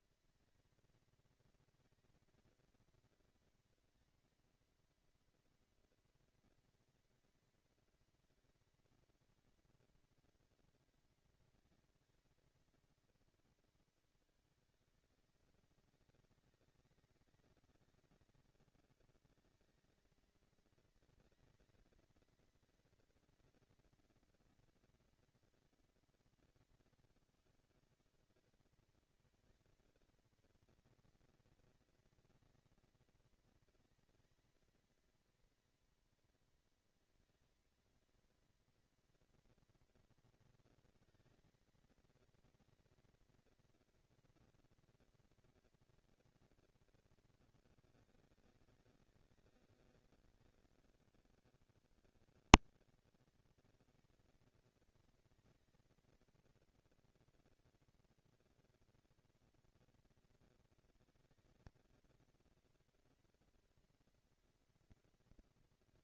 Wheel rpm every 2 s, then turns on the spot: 230, 230, 240, 240, 230, 230, 220, 210, 200, 200, 220, 230, 230, 200, 210, 230, 230, 230, 230, 230, 230, 230, 240, 240, 200, 200, 200, 230, 230, 230, 230, 230, 230.
none